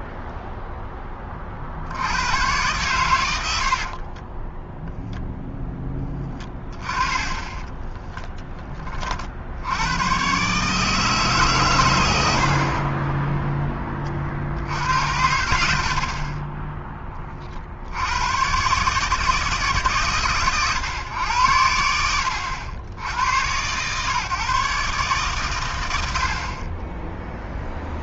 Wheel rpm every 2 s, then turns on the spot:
30, 80, 0, 10, 60, 160, 0, 100, 30, 140, 100, 110, 130, 0.
6-8